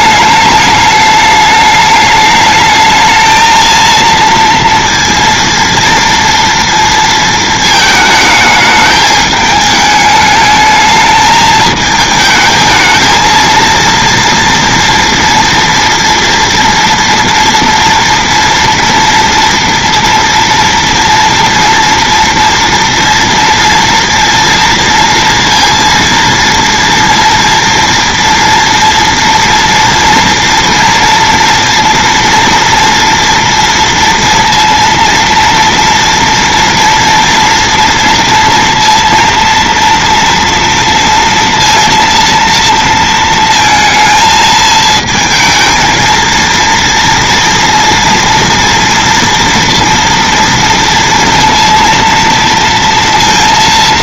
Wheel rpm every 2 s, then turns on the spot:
210, 220, 230, 230, 210, 210, 220, 230, 230, 230, 230, 230, 230, 240, 230, 230, 240, 230, 230, 230, 230, 230, 220, 230, 230, 230, 230.
none